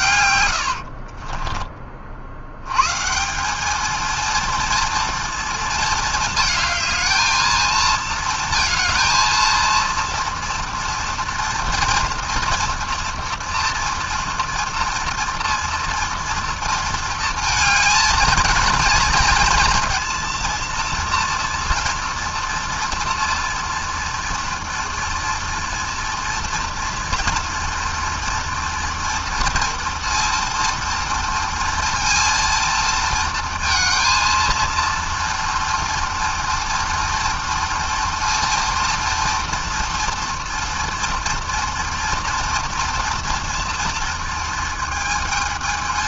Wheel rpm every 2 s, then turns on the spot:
40, 170, 230, 220, 230, 230, 230, 230, 230, 230, 230, 230, 230, 230, 230, 230, 230, 230, 230, 240, 230, 230, 230.
0-2